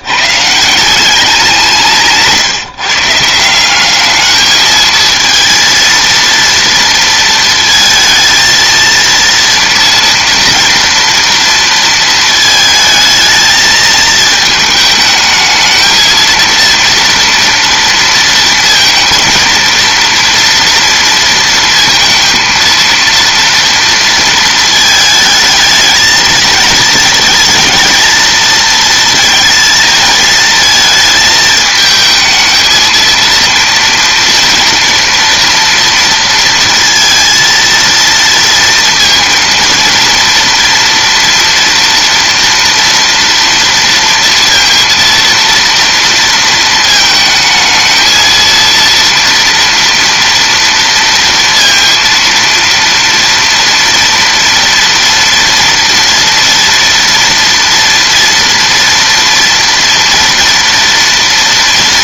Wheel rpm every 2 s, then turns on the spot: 160, 150, 220, 230, 230, 230, 220, 220, 230, 230, 230, 230, 220, 220, 230, 220, 220, 230, 230, 230, 230, 230, 230, 220, 230, 230, 230, 230, 230, 230, 230.
none